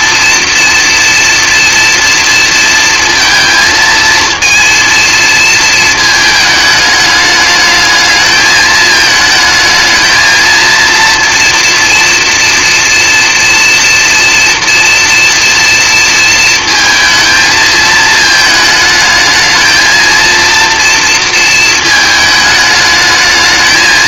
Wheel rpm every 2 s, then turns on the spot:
240, 230, 230, 210, 220, 230, 230, 230, 220, 220, 230, 220.
none